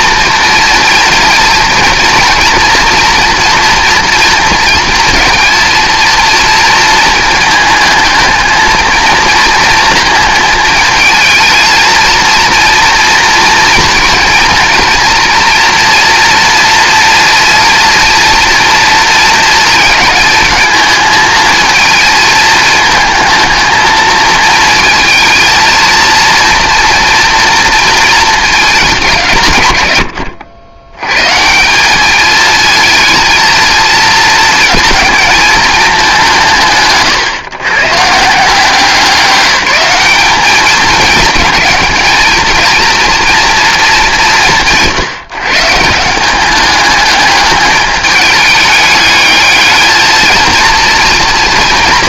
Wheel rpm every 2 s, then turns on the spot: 230, 230, 230, 230, 220, 220, 230, 230, 230, 230, 220, 220, 220, 230, 210, 90, 220, 230, 150, 180, 210, 220, 170, 200, 210, 220.
none